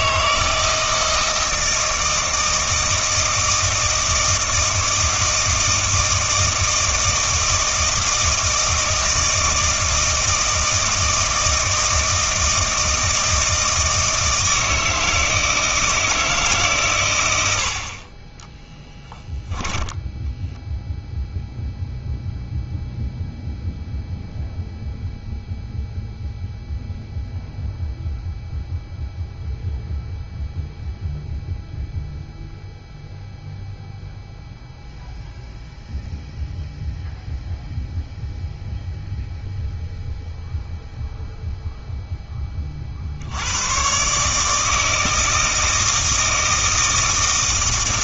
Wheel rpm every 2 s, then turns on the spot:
160, 160, 160, 160, 160, 160, 160, 160, 130, 10, 0, 0, 0, 0, 0, 0, 0, 0, 0, 0, 0, 40, 160, 160.
none